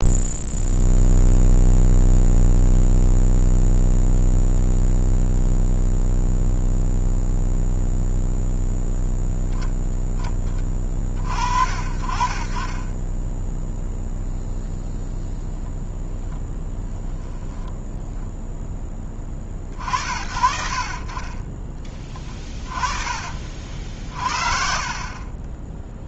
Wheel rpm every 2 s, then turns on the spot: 0, 0, 0, 0, 0, 20, 30, 0, 0, 0, 60, 30, 50.
none